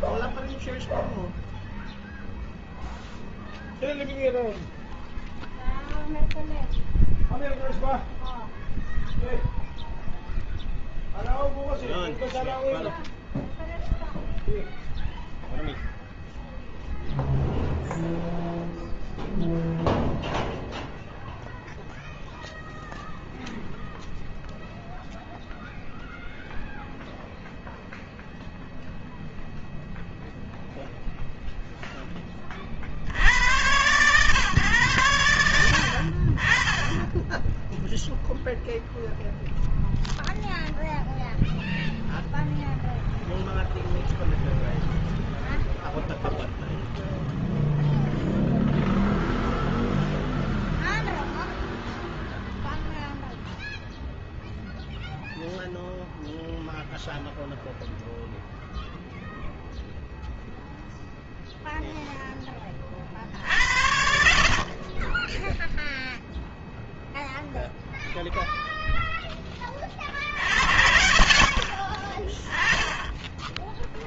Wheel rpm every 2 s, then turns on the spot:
0, 0, 0, 0, 0, 0, 0, 0, 0, 0, 0, 0, 0, 0, 0, 0, 60, 120, 40, 0, 0, 0, 0, 0, 0, 0, 0, 0, 0, 0, 0, 50, 10, 0, 0, 50, 10.
none